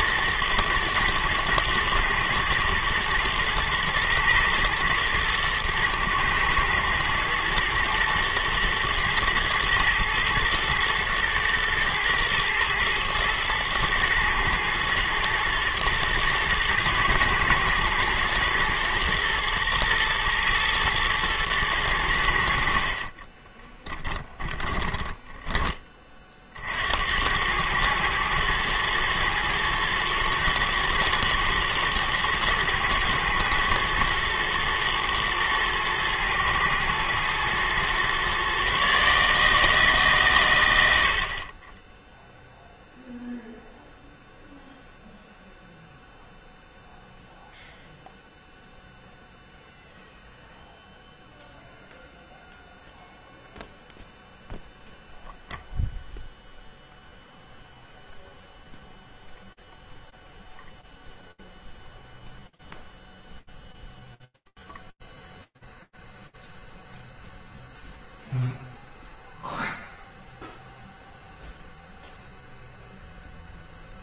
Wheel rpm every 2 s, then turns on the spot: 110, 110, 110, 110, 110, 110, 110, 110, 110, 120, 110, 70, 20, 50, 110, 110, 120, 110, 110, 130, 110, 0, 0, 0, 0, 0, 0, 0, 0, 0, 0, 0, 0, 0, 0, 0, 0.
24-26